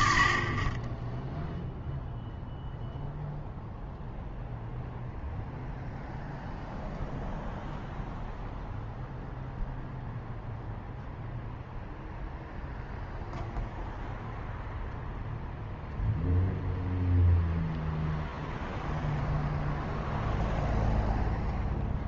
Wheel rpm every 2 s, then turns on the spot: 20, 0, 0, 0, 0, 0, 0, 0, 0, 0, 0.
none